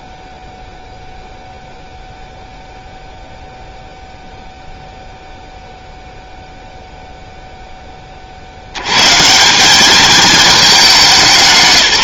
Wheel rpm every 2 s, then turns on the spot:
0, 0, 0, 0, 130, 200.
none